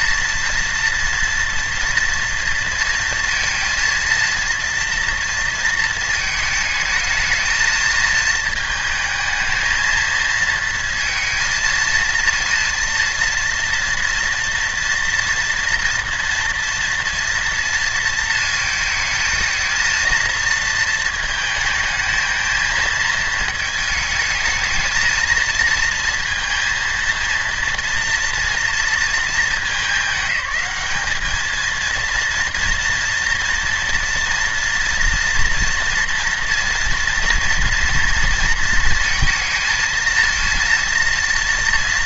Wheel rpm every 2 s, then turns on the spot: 240, 230, 230, 220, 220, 230, 230, 230, 230, 230, 220, 220, 220, 220, 230, 210, 230, 230, 230, 230, 230.
none